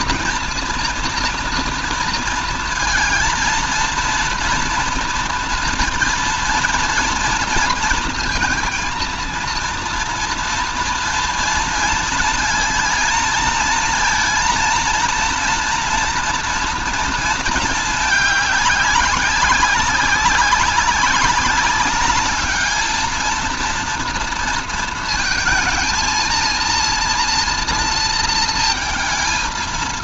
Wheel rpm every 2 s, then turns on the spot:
230, 230, 230, 230, 230, 230, 230, 230, 230, 210, 200, 210, 230, 230, 230.
none